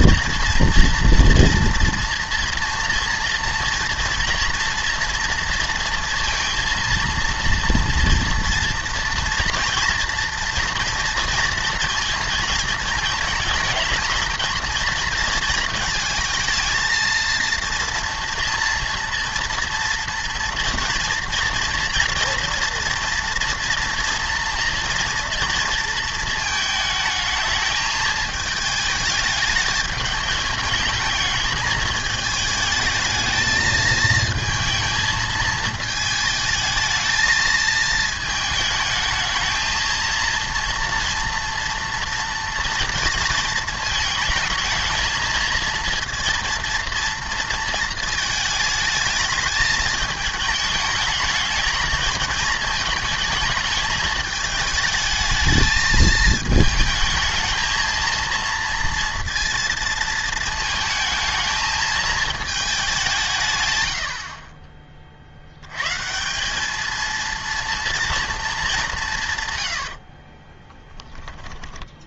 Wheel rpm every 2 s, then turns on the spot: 230, 230, 240, 230, 240, 240, 220, 220, 230, 230, 230, 230, 230, 220, 220, 210, 220, 220, 220, 220, 230, 230, 220, 230, 220, 210, 220, 210, 220, 230, 220, 200, 30, 210, 190, 10.
70-72